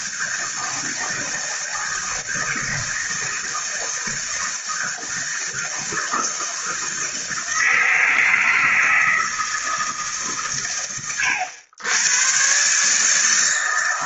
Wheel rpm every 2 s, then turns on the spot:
160, 160, 160, 160, 160, 110, 140.
none